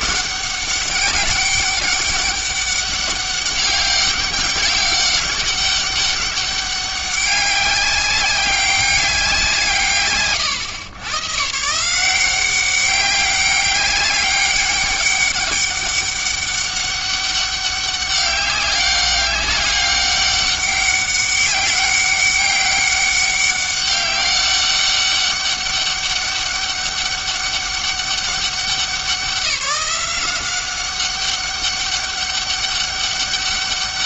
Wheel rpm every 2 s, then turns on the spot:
200, 200, 190, 200, 200, 120, 190, 200, 200, 200, 200, 200, 200, 200, 190, 190, 200.
none